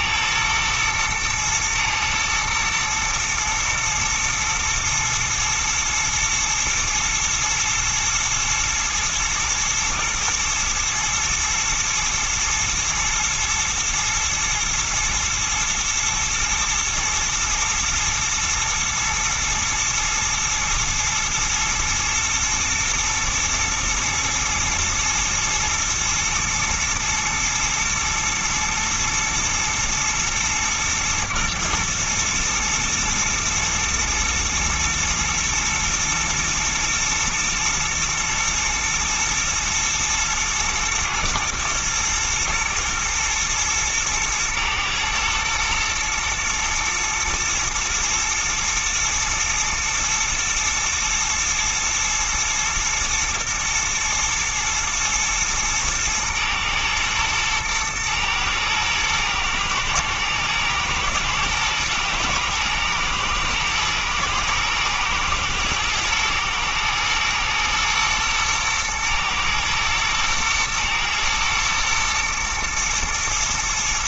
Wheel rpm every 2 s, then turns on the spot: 120, 110, 120, 120, 110, 110, 120, 110, 110, 120, 110, 120, 120, 110, 110, 110, 110, 120, 110, 110, 110, 110, 110, 110, 110, 110, 110, 110, 110, 110, 110, 110, 120, 110, 110, 110, 120.
none